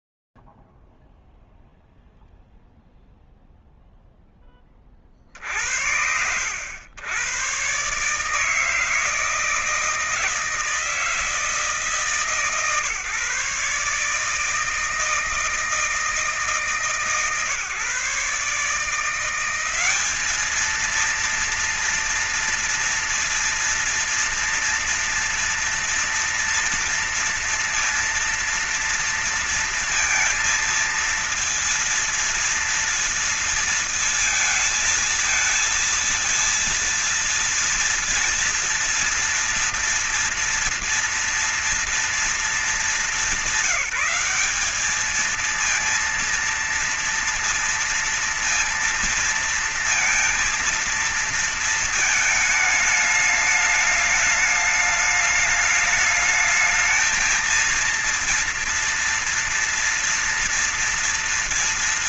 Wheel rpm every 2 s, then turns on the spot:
0, 0, 0, 70, 130, 160, 160, 150, 160, 150, 200, 230, 230, 240, 230, 230, 230, 230, 230, 230, 230, 230, 200, 230, 230, 230, 220, 210, 210, 230, 240.
none